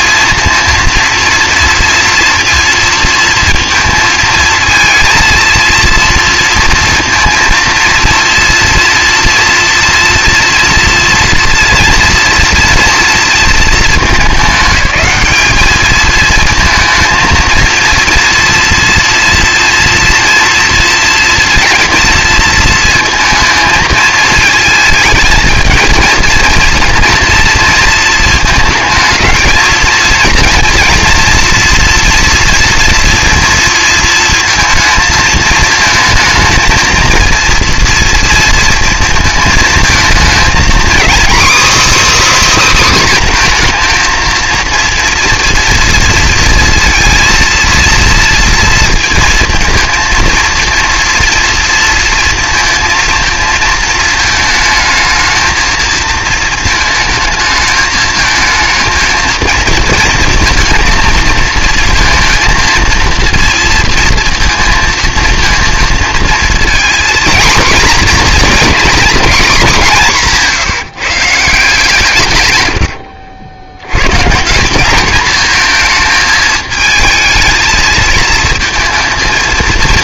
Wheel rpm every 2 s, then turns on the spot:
230, 230, 220, 230, 230, 230, 230, 210, 230, 230, 230, 230, 220, 230, 230, 230, 230, 220, 230, 230, 250, 300, 230, 230, 230, 230, 230, 220, 220, 220, 230, 230, 230, 230, 250, 170, 100, 180, 220, 230.
72-74